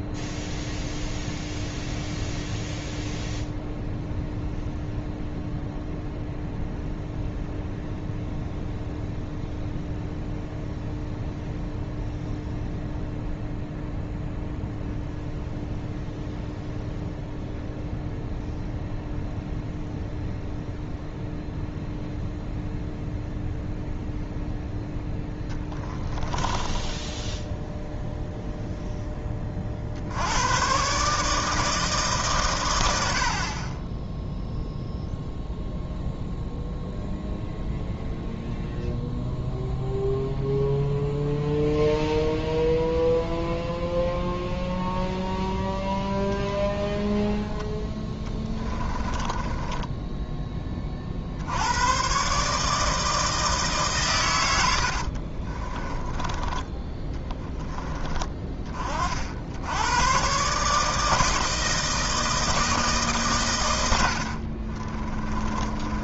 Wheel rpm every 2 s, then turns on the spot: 0, 0, 0, 0, 0, 0, 0, 0, 0, 0, 0, 0, 0, 10, 0, 120, 120, 0, 0, 0, 0, 0, 0, 10, 20, 20, 150, 80, 20, 30, 150, 160, 30.
26-28 48-50 64-66